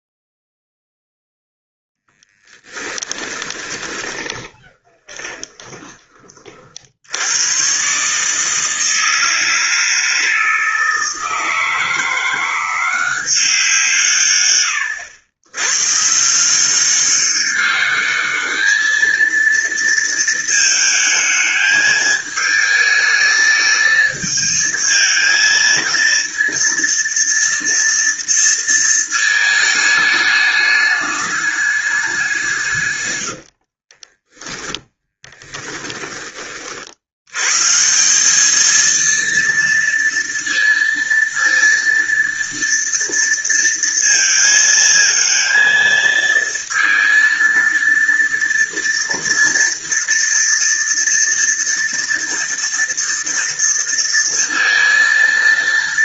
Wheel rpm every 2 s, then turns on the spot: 0, 10, 30, 40, 150, 160, 170, 130, 160, 210, 220, 220, 220, 230, 230, 210, 170, 10, 20, 200, 230, 230, 230, 230, 230, 230, 230, 230.
2-6 34-36